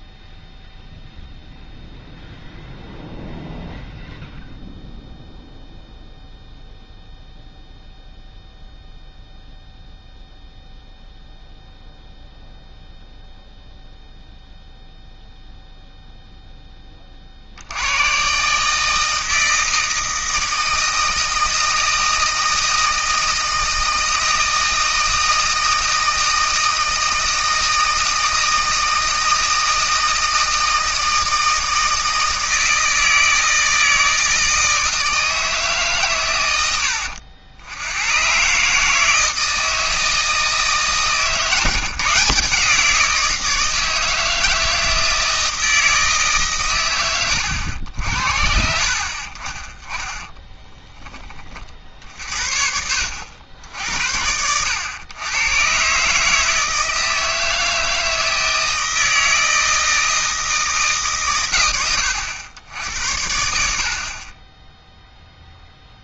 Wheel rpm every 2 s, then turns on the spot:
0, 0, 0, 0, 0, 0, 0, 0, 10, 150, 160, 160, 160, 160, 160, 160, 160, 160, 90, 140, 160, 160, 160, 130, 60, 10, 60, 90, 160, 160, 160, 90, 10.
none